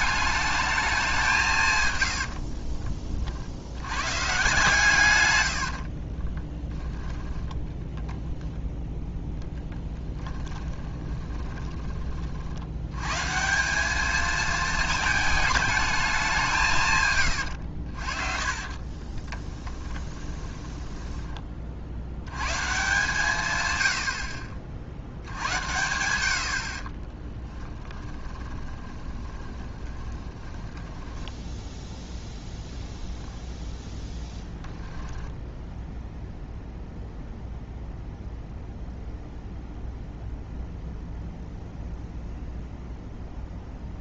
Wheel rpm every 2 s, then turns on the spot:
210, 40, 120, 10, 10, 20, 90, 220, 150, 40, 20, 140, 60, 50, 20, 10, 0, 10, 0, 0, 0, 0.
2-4 10-12 18-22 28-30 34-36